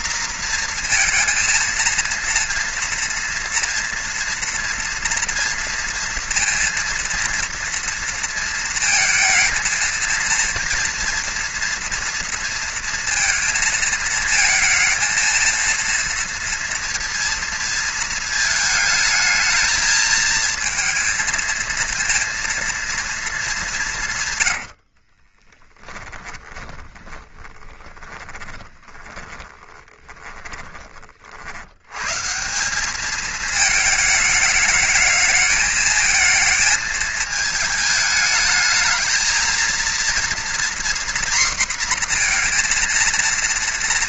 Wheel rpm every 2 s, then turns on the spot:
230, 230, 240, 230, 220, 230, 230, 230, 230, 220, 230, 230, 40, 20, 20, 40, 200, 210, 220, 220, 240, 230.
24-30